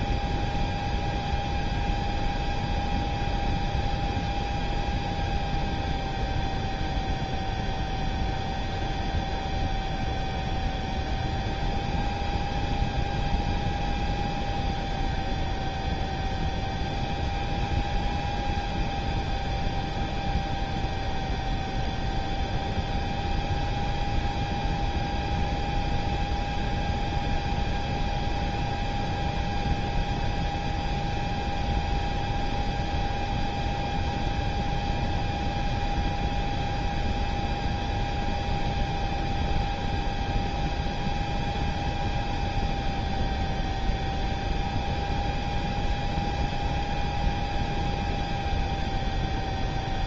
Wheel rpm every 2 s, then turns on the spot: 0, 0, 0, 0, 0, 0, 0, 0, 0, 0, 0, 0, 0, 0, 0, 0, 0, 0, 0, 0, 0, 0, 0, 0, 0.
none